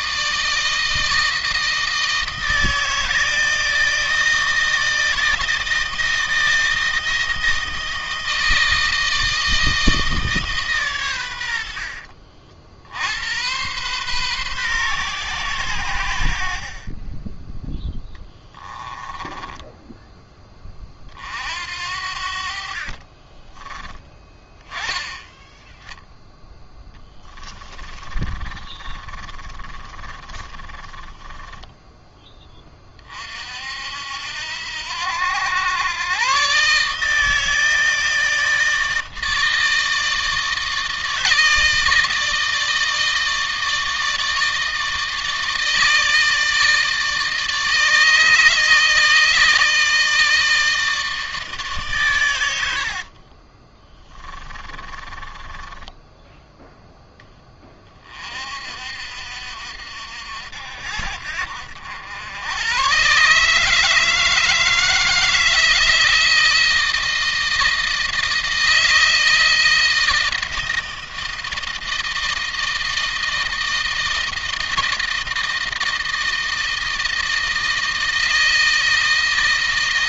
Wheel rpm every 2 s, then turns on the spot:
160, 160, 160, 160, 160, 140, 70, 130, 40, 10, 20, 50, 10, 10, 30, 20, 20, 80, 140, 160, 160, 160, 160, 160, 160, 160, 80, 20, 10, 60, 70, 110, 160, 160, 160, 160, 160, 160, 160, 160.
18-20 22-24 26-32 52-56